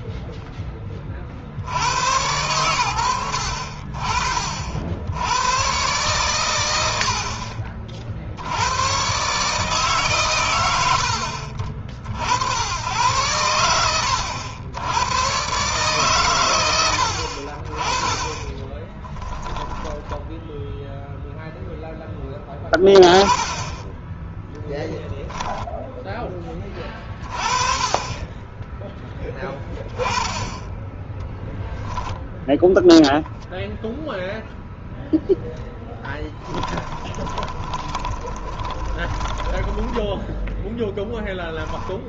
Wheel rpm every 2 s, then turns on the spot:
20, 90, 70, 80, 110, 90, 100, 100, 80, 10, 0, 10, 10, 20, 10, 10, 10, 0, 20, 20, 10.
18-20 24-26 36-40